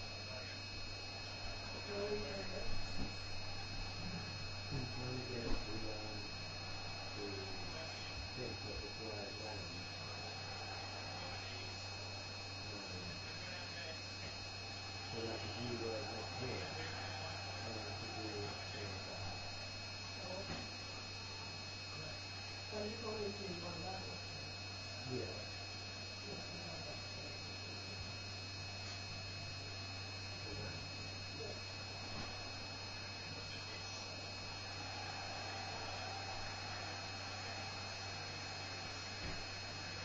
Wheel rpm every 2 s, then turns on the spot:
0, 0, 0, 0, 0, 0, 0, 0, 0, 0, 0, 0, 0, 0, 0, 0, 0, 0, 0, 0.
none